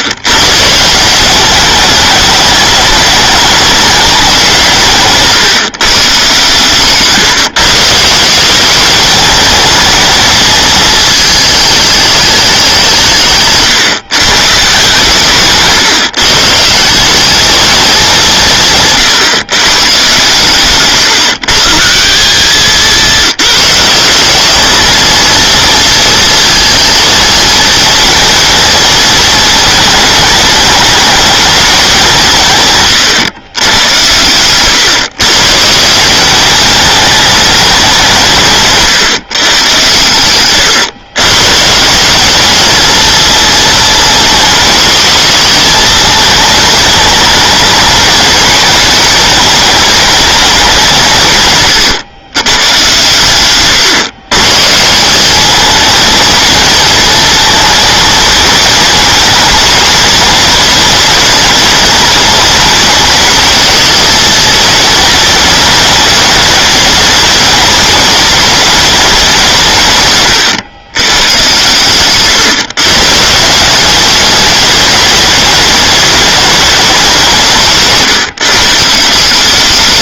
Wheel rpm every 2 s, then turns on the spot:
160, 210, 170, 140, 190, 220, 190, 140, 160, 160, 140, 200, 220, 230, 220, 220, 150, 130, 210, 150, 120, 220, 220, 220, 220, 190, 120, 140, 220, 210, 210, 210, 220, 210, 210, 110, 130, 210, 210, 150.
6-8 38-42